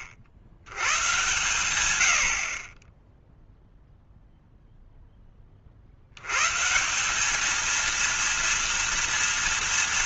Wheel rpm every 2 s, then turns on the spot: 90, 20, 0, 140, 230.
none